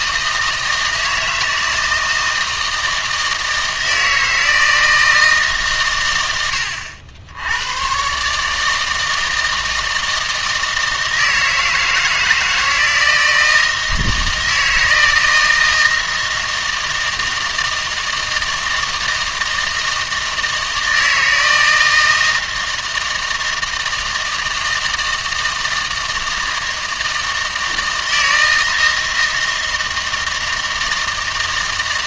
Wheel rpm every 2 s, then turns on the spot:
160, 160, 160, 80, 160, 160, 160, 160, 160, 160, 160, 160, 160, 160, 160, 160.
none